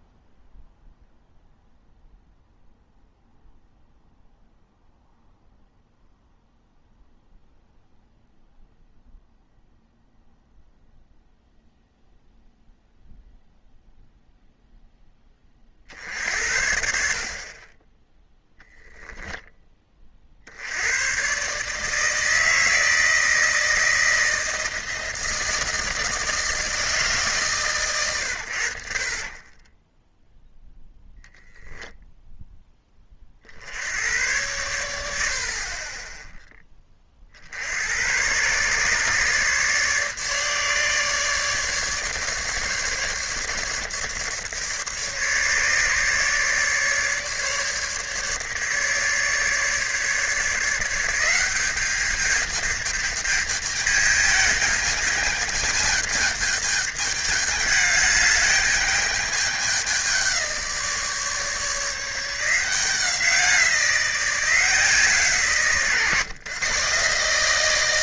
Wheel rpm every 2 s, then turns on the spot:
0, 0, 0, 0, 0, 0, 0, 0, 60, 0, 80, 160, 160, 160, 60, 0, 10, 100, 20, 130, 150, 140, 150, 150, 150, 160, 210, 210, 210, 210, 180, 180, 170, 130.
none